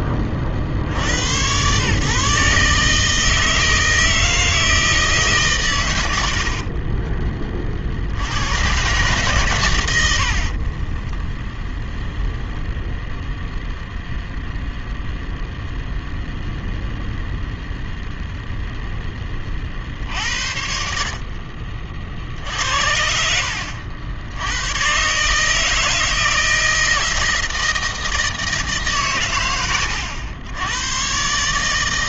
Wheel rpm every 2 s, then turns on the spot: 50, 150, 160, 50, 110, 30, 0, 0, 0, 0, 60, 60, 120, 160, 150, 100.
6-8 10-12